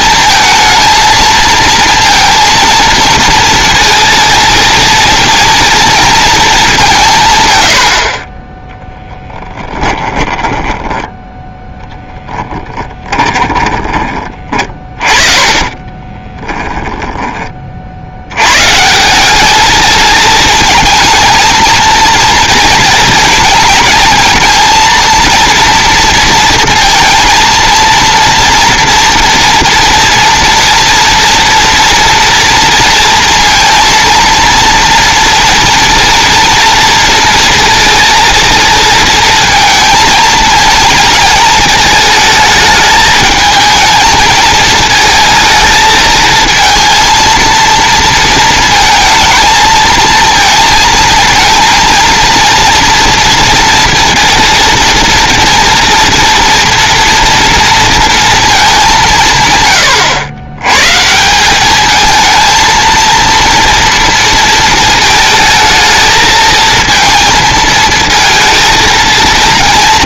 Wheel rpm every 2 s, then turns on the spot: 230, 230, 230, 210, 10, 10, 10, 40, 20, 150, 220, 220, 230, 230, 230, 240, 230, 230, 230, 230, 220, 220, 220, 230, 230, 230, 230, 230, 230, 200, 130, 230, 220, 220, 230.
10-18